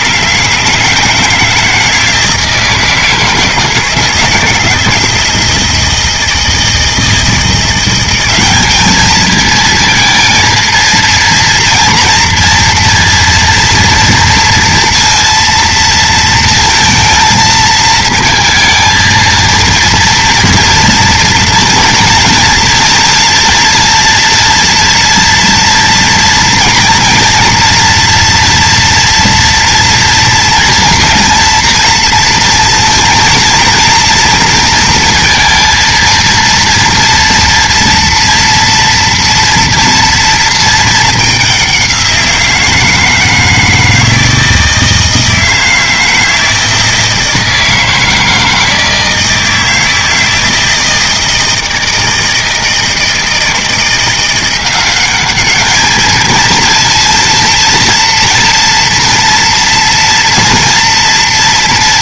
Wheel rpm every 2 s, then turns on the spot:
160, 160, 160, 160, 210, 230, 230, 230, 220, 230, 230, 230, 240, 230, 230, 230, 230, 230, 230, 230, 220, 170, 160, 160, 160, 160, 160, 180, 230, 230, 230.
none